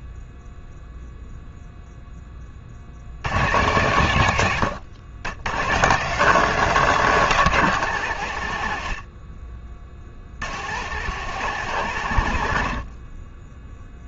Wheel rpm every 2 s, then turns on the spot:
0, 40, 100, 190, 90, 100, 70.
none